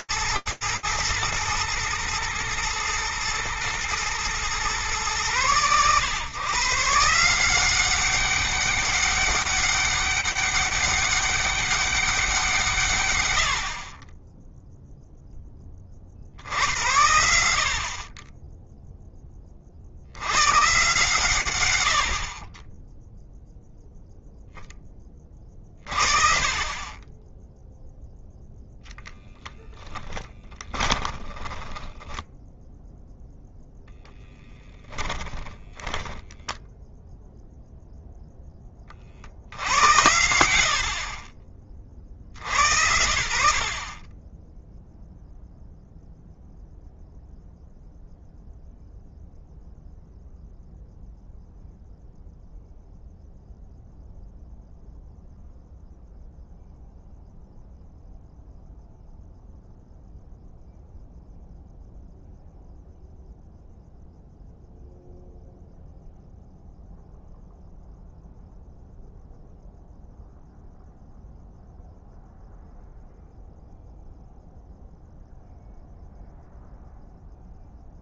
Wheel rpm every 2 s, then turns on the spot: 120, 110, 110, 160, 200, 200, 120, 20, 70, 40, 100, 0, 50, 0, 20, 10, 0, 10, 0, 80, 50, 50, 0, 0, 0, 0, 0, 0, 0, 0, 0, 0, 0, 0, 0, 0, 0, 0, 0.
28-32